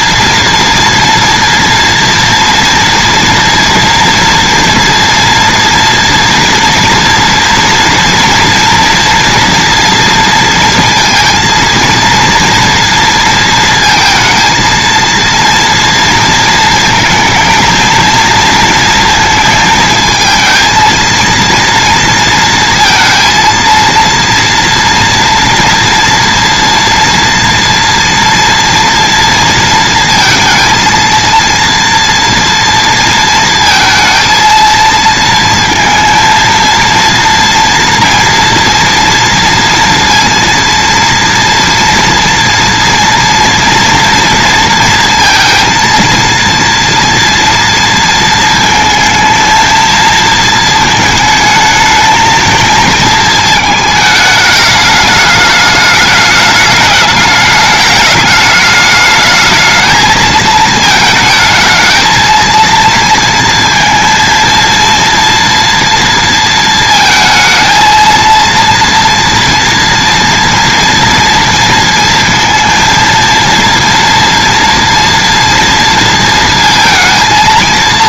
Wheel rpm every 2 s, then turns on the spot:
230, 230, 230, 230, 230, 230, 230, 220, 230, 230, 230, 230, 230, 230, 240, 230, 230, 230, 230, 230, 230, 230, 230, 230, 230, 230, 230, 210, 210, 210, 220, 230, 230, 230, 230, 230, 230, 230, 230.
none